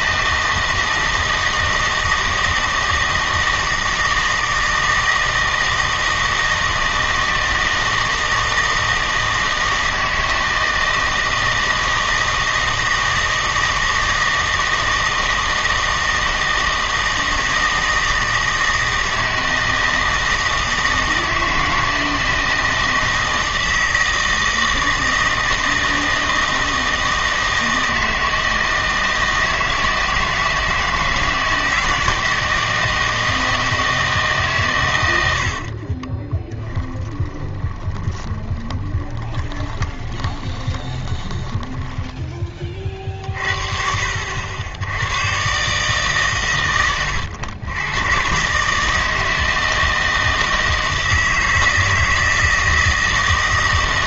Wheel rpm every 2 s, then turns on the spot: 160, 160, 160, 160, 160, 160, 160, 160, 160, 160, 160, 160, 160, 160, 160, 160, 160, 130, 10, 20, 20, 30, 80, 120, 150, 160, 160.
36-42